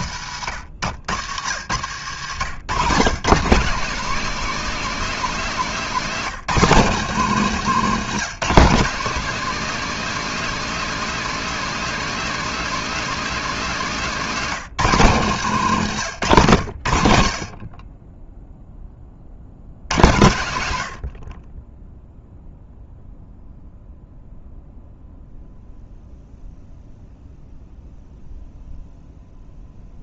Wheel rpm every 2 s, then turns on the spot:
100, 150, 230, 190, 210, 230, 230, 170, 90, 30, 80, 0, 0, 0, 0.
none